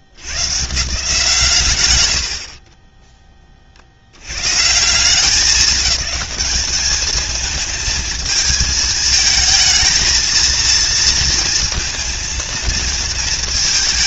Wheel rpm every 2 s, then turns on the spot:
90, 80, 90, 210, 220, 220, 220.
none